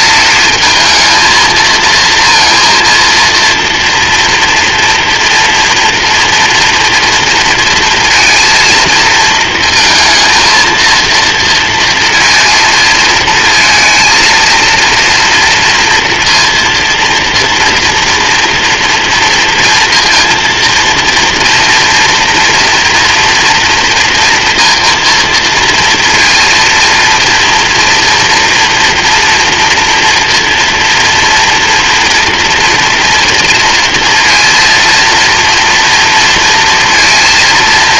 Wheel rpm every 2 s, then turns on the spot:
220, 230, 230, 230, 230, 230, 230, 230, 230, 230, 230, 230, 230, 230, 230, 230, 240, 230, 230.
none